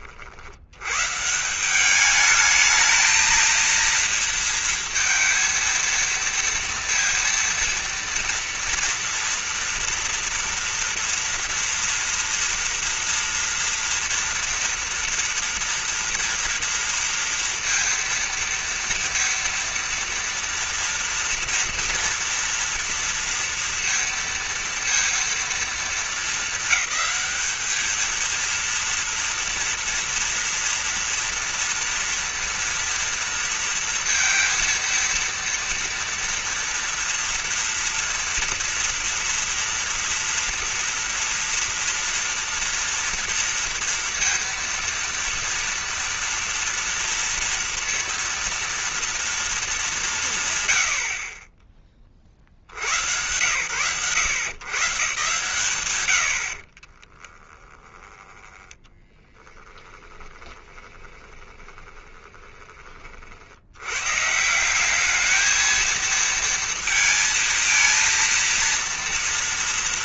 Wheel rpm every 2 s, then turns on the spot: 60, 210, 230, 230, 230, 230, 230, 230, 230, 230, 230, 230, 230, 220, 230, 230, 230, 230, 230, 230, 230, 230, 230, 230, 230, 170, 40, 120, 100, 20, 10, 20, 140, 220, 230.
60-64